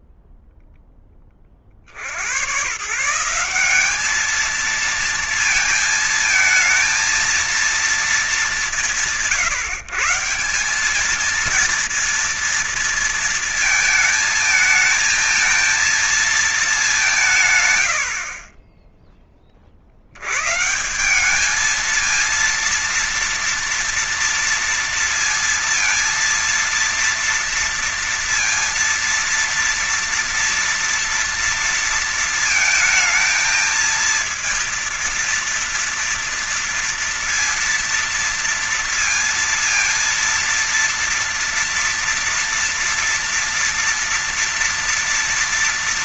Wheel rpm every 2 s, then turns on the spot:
0, 120, 220, 230, 180, 190, 230, 220, 210, 30, 140, 230, 230, 230, 230, 230, 230, 230, 230, 230, 230, 230, 230.
none